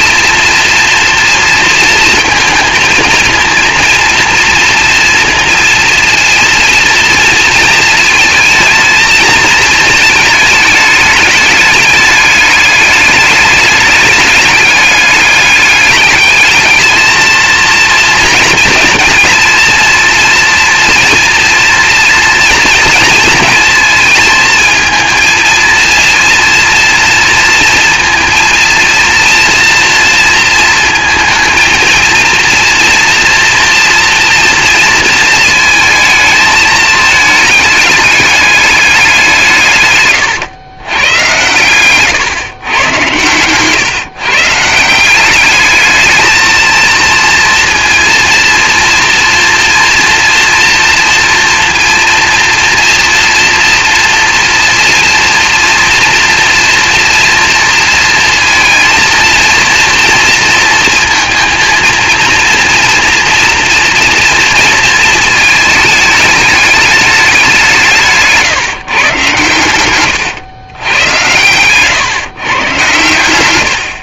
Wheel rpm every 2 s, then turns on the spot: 230, 230, 230, 240, 230, 210, 210, 210, 220, 230, 240, 230, 220, 230, 230, 230, 230, 230, 220, 200, 100, 110, 170, 230, 240, 230, 230, 230, 230, 230, 230, 230, 230, 200, 120, 100, 110.
none